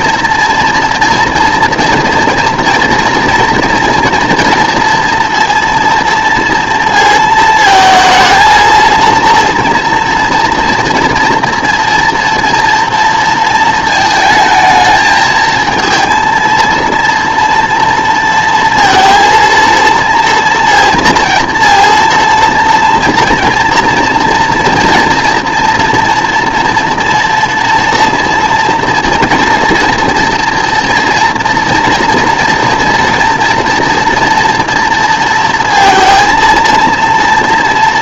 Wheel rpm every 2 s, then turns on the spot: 240, 230, 230, 230, 230, 230, 230, 220, 230, 230, 230, 230, 230, 230, 230, 230, 230, 230, 230.
none